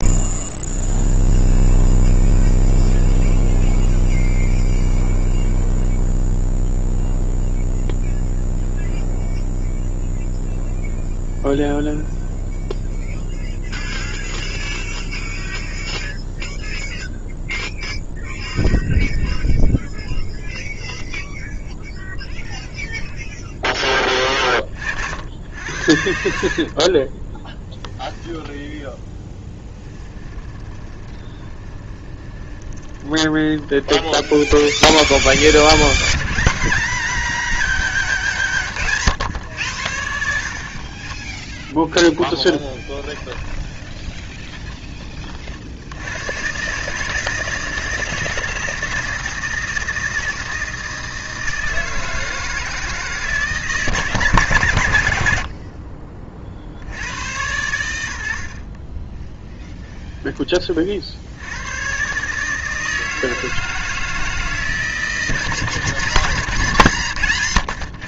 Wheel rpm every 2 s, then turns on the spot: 0, 0, 0, 0, 0, 0, 0, 0, 0, 0, 0, 0, 50, 40, 10, 10, 20, 10, 190, 150, 40, 20, 30, 150, 160, 160, 160, 110, 70, 30, 50, 160, 160, 150.
26-34 42-44 58-60